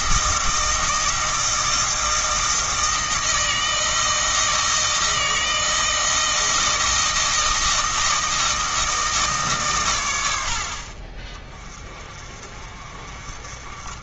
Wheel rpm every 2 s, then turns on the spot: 160, 160, 160, 160, 160, 60, 40.
none